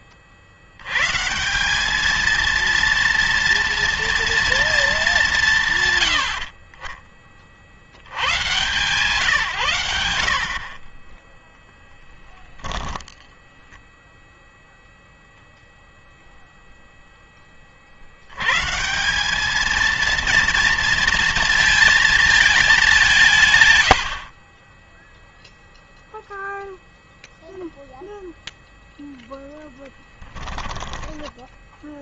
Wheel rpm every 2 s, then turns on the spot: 70, 230, 220, 40, 130, 40, 20, 0, 0, 130, 230, 210, 30, 0, 0, 10.
12-14 30-32